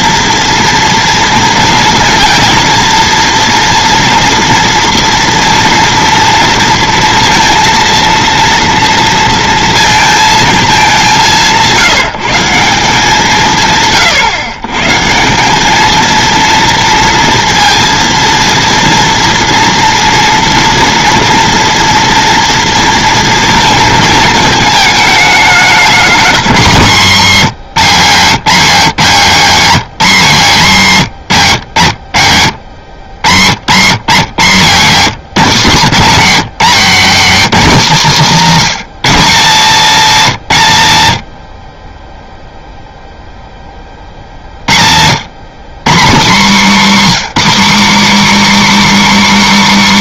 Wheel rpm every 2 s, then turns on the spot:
230, 230, 230, 230, 230, 210, 180, 140, 230, 230, 230, 230, 220, 190, 200, 160, 90, 190, 210, 220, 160, 0, 80, 250, 320.
36-38